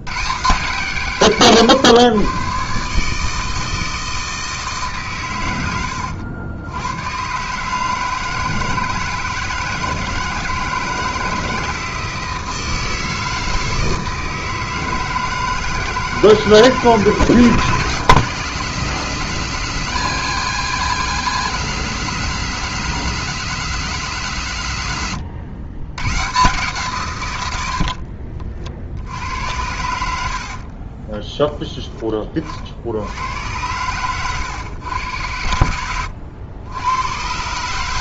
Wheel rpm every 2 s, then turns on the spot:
140, 130, 150, 90, 160, 160, 160, 160, 160, 170, 170, 180, 130, 140, 50, 40, 60, 110, 100.
30-32